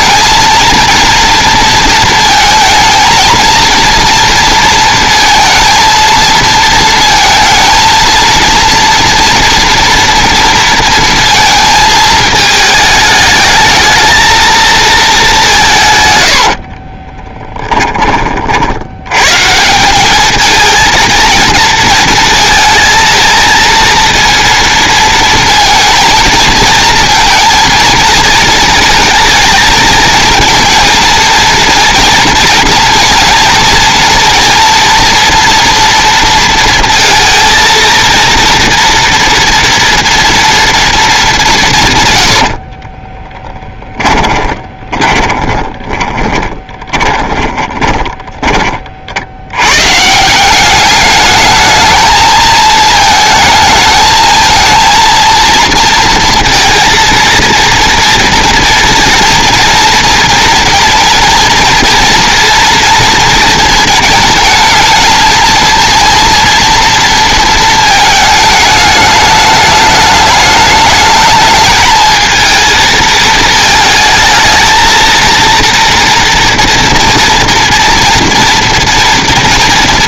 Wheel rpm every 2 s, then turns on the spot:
230, 230, 230, 230, 240, 230, 220, 220, 50, 80, 230, 230, 230, 230, 230, 230, 230, 230, 230, 230, 230, 40, 20, 20, 30, 200, 220, 230, 230, 240, 230, 230, 220, 230, 210, 220, 220, 220, 230, 230.
16-18 42-48